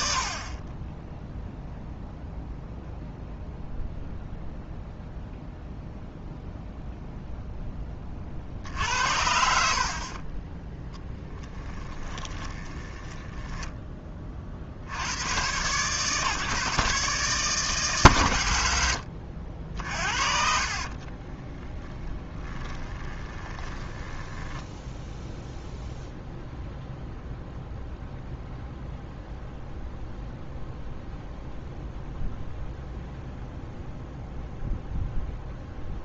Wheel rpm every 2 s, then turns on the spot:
20, 0, 0, 0, 60, 10, 20, 50, 140, 80, 40, 10, 20, 0, 0, 0, 0, 0.
12-14 20-26